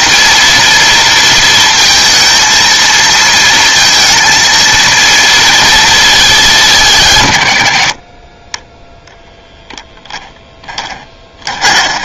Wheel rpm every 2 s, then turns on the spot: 230, 230, 230, 170, 10, 10.
10-12